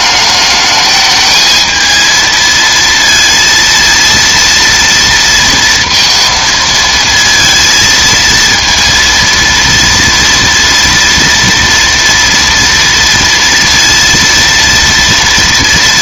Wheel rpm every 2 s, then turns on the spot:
210, 230, 230, 230, 230, 230, 230, 230.
none